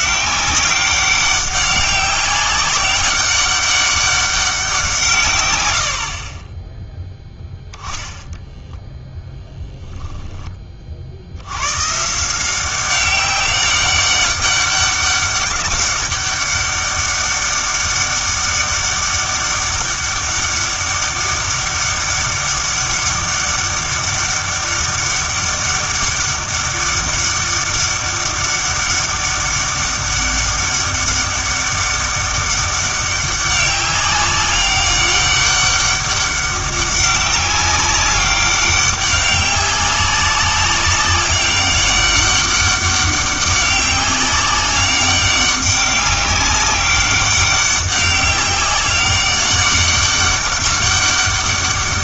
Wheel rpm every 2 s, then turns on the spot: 200, 190, 180, 10, 0, 30, 190, 200, 200, 200, 200, 200, 200, 200, 200, 200, 200, 200, 200, 200, 200, 200, 200, 200, 200, 200.
6-8